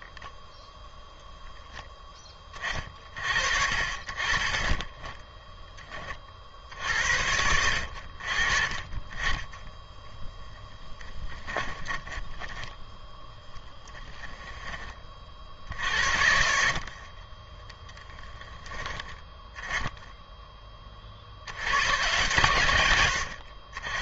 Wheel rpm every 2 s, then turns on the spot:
0, 30, 30, 60, 50, 20, 10, 10, 60, 10, 20, 110.
10-14 16-18